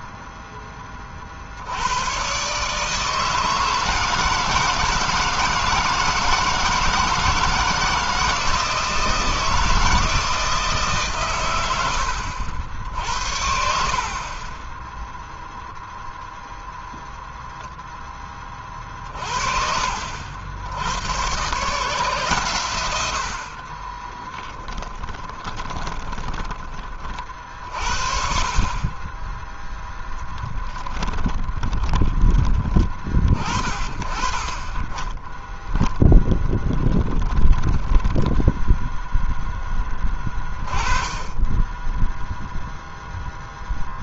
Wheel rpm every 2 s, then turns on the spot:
20, 150, 160, 170, 160, 140, 60, 10, 0, 50, 90, 110, 20, 40, 30, 20, 30, 10, 10, 10, 20, 0.
24-26 30-32 36-38